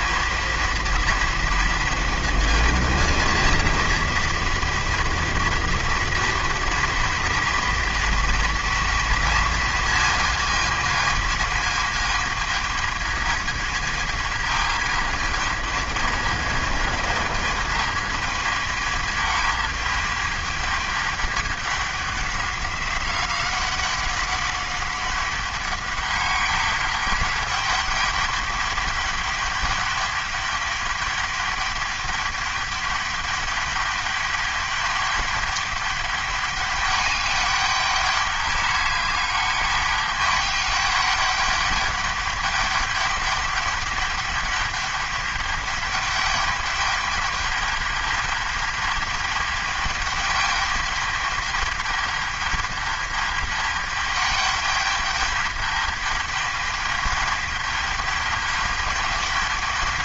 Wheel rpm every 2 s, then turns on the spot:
230, 230, 230, 230, 230, 220, 220, 220, 220, 220, 210, 190, 200, 200, 200, 200, 210, 200, 200, 200, 210, 200, 210, 210, 210, 210, 210, 210, 210, 210.
none